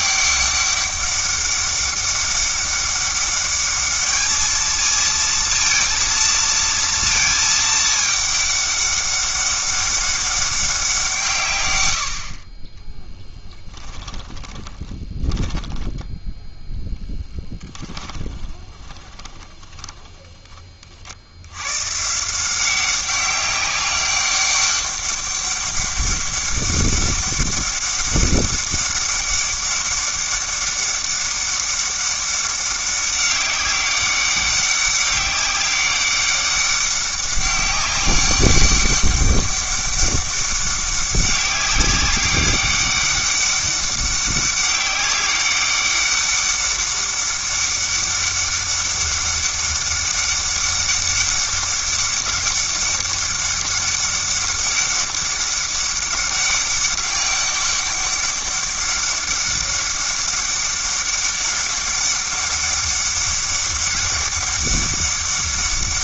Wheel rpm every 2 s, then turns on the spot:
200, 200, 220, 230, 200, 190, 20, 20, 10, 20, 40, 190, 200, 200, 200, 200, 200, 200, 200, 200, 200, 200, 200, 200, 200, 200, 200, 200, 200, 200, 200, 200, 200.
14-16 18-20